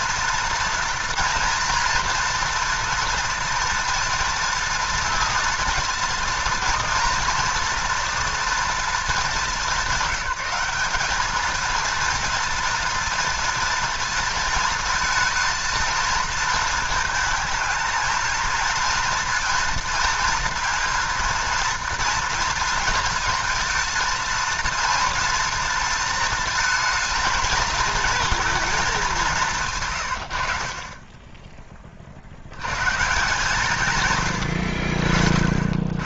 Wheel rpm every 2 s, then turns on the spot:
230, 230, 230, 230, 230, 200, 230, 220, 220, 230, 230, 230, 230, 230, 220, 40, 140, 60.
none